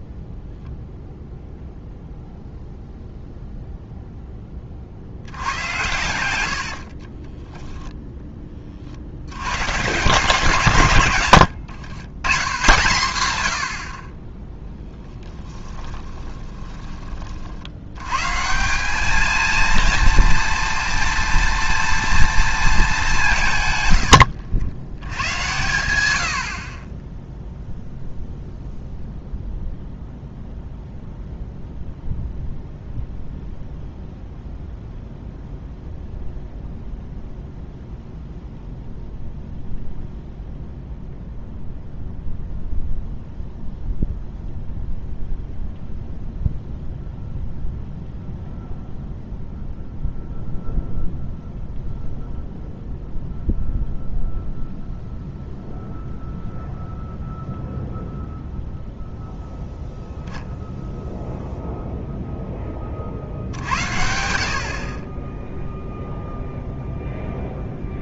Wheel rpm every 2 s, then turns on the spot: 0, 0, 30, 90, 30, 140, 110, 10, 30, 170, 240, 230, 80, 60, 0, 0, 0, 0, 0, 0, 0, 0, 0, 0, 0, 0, 0, 0, 0, 0, 0, 10, 60, 0.
6-8 16-18